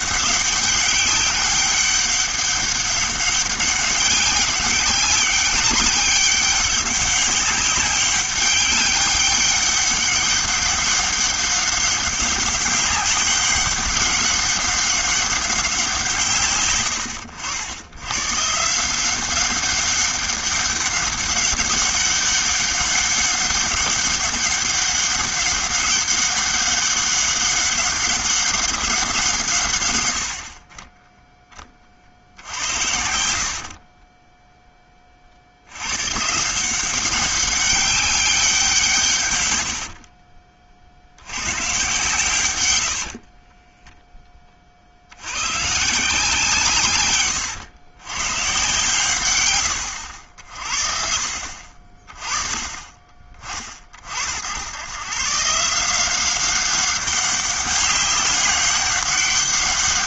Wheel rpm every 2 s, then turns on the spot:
190, 200, 200, 200, 200, 200, 190, 200, 120, 140, 200, 200, 200, 200, 190, 40, 70, 10, 170, 170, 50, 90, 40, 140, 140, 60, 30, 90, 190, 200.
32-34